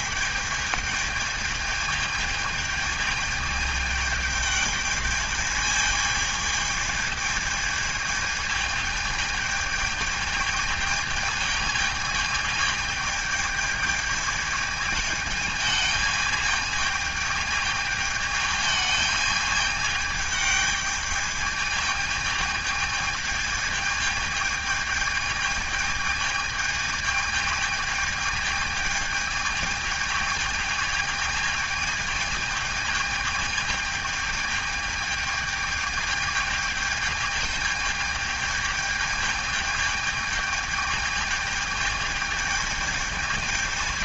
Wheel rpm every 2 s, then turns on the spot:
210, 220, 210, 210, 220, 220, 220, 220, 220, 210, 210, 220, 220, 220, 220, 220, 220, 220, 220, 220, 220, 220.
none